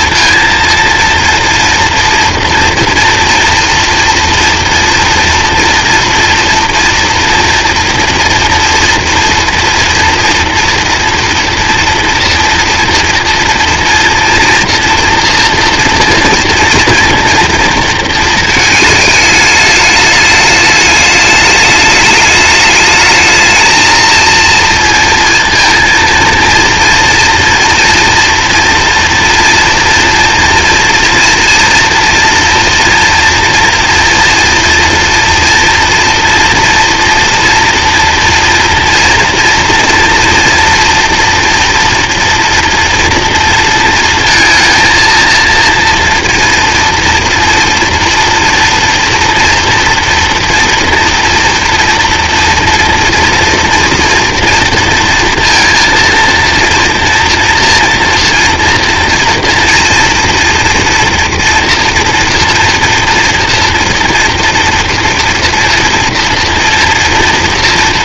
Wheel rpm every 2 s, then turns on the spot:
230, 230, 230, 230, 230, 230, 230, 230, 240, 220, 210, 210, 230, 230, 240, 230, 240, 230, 230, 240, 230, 230, 230, 230, 230, 240, 240, 230, 230, 230, 230, 230, 230, 230.
none